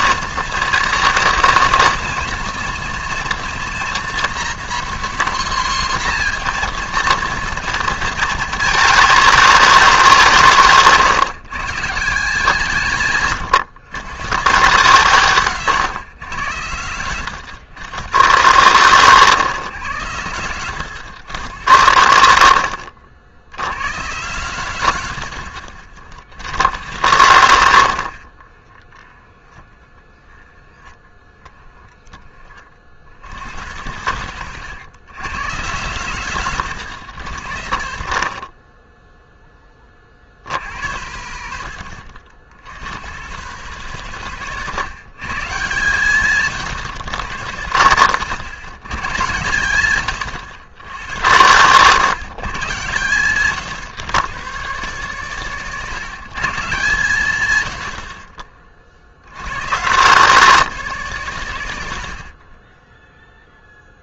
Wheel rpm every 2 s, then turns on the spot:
220, 220, 240, 230, 210, 150, 160, 150, 90, 130, 100, 70, 90, 100, 20, 10, 50, 100, 110, 30, 80, 80, 130, 130, 120, 110, 120, 150, 140, 40, 190, 20.
28-30